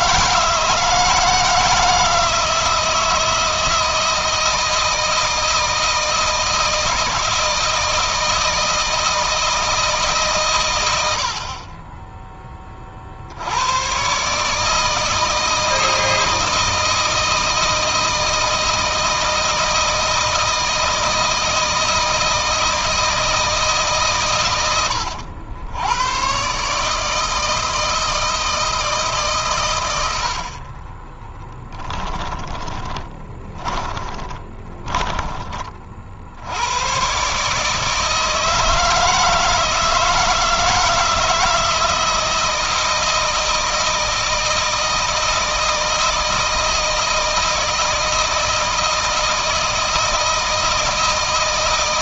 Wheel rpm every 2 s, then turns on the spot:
160, 160, 160, 160, 160, 100, 30, 150, 160, 160, 160, 160, 110, 140, 160, 40, 10, 10, 100, 160, 160, 160, 160, 160, 160, 160.
24-26 30-34